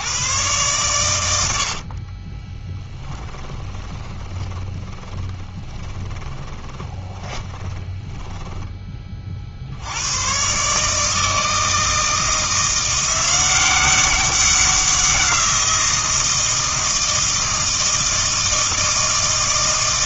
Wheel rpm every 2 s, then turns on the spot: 120, 20, 20, 20, 20, 140, 170, 190, 160, 160.
2-10